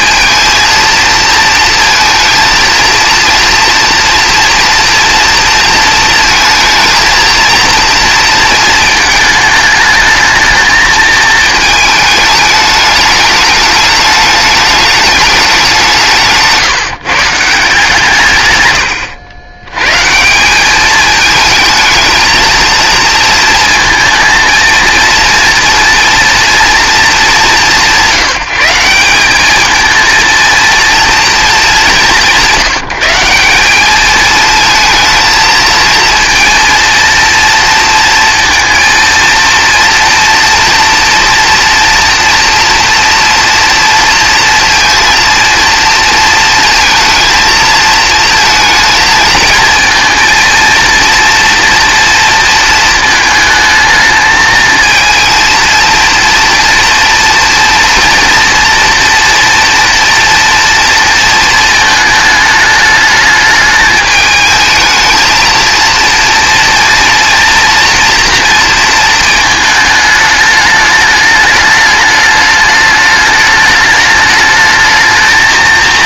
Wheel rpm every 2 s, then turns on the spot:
230, 230, 240, 230, 230, 220, 210, 210, 160, 110, 190, 230, 230, 230, 180, 230, 190, 220, 230, 230, 230, 230, 230, 220, 220, 230, 230, 220, 230, 230, 230, 220, 220, 230, 230, 210, 210, 210.
none